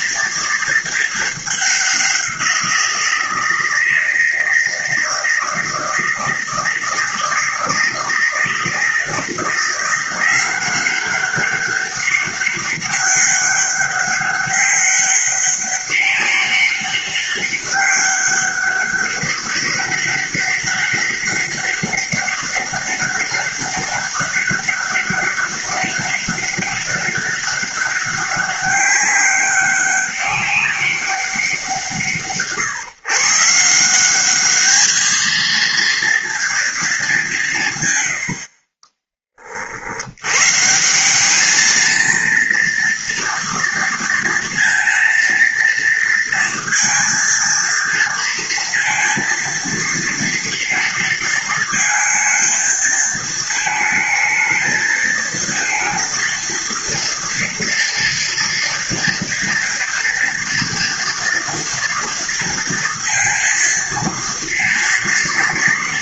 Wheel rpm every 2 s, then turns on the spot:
230, 180, 160, 160, 160, 180, 200, 200, 200, 190, 200, 200, 200, 200, 200, 200, 150, 200, 230, 40, 140, 240, 230, 230, 230, 230, 230, 220, 230, 240, 230, 230, 230.
none